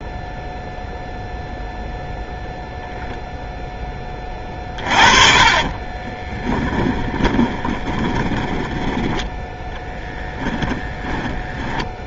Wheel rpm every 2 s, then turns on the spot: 0, 0, 30, 20, 20, 10.
4-12